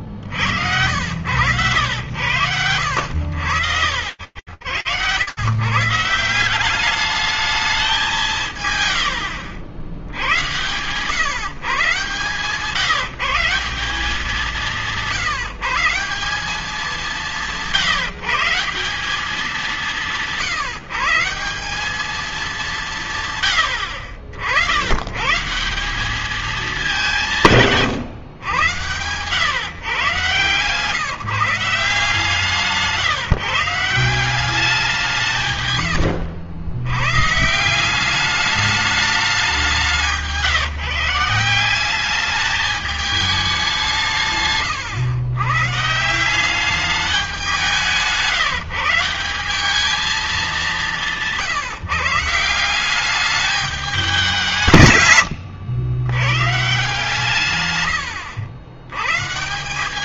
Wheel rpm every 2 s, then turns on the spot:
80, 90, 110, 210, 70, 140, 160, 170, 180, 190, 170, 130, 130, 180, 120, 160, 160, 150, 140, 200, 160, 210, 130, 190, 180, 170, 200, 130, 140, 130.
2-4